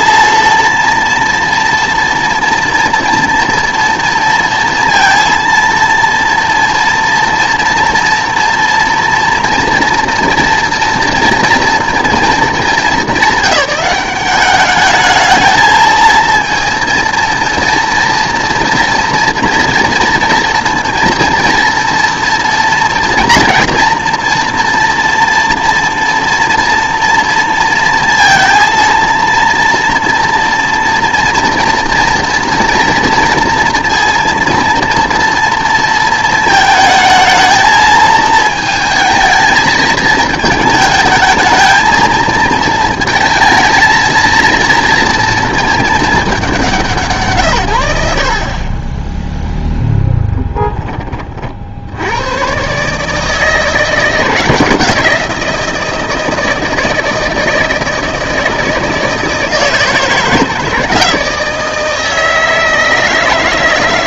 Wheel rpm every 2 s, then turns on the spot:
230, 240, 230, 230, 230, 230, 210, 200, 230, 230, 230, 240, 240, 240, 230, 240, 230, 230, 220, 220, 220, 220, 230, 190, 40, 10, 130, 170, 160, 160, 160, 160.
none